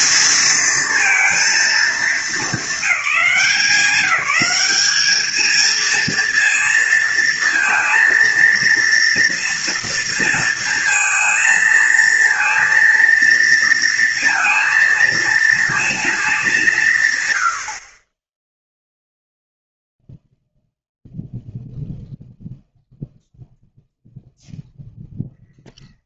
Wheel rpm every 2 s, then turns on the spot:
220, 220, 200, 230, 230, 230, 230, 230, 190, 0, 0, 0, 0.
none